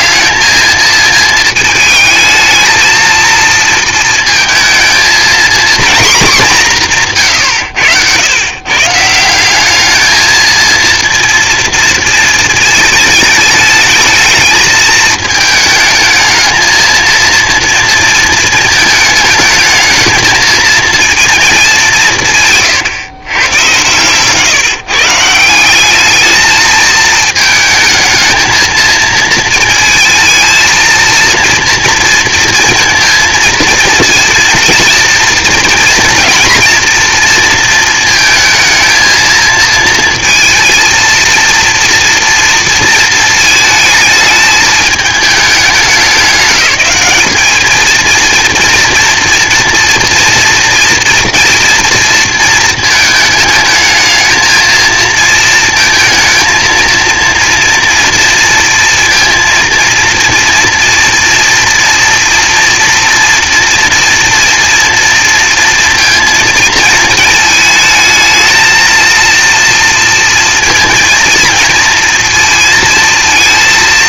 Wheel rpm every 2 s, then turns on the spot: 220, 220, 220, 170, 140, 230, 220, 220, 220, 230, 230, 150, 150, 220, 220, 230, 230, 230, 230, 220, 230, 230, 220, 210, 230, 230, 220, 220, 230, 230, 240, 230, 240, 230, 220, 230, 230.
none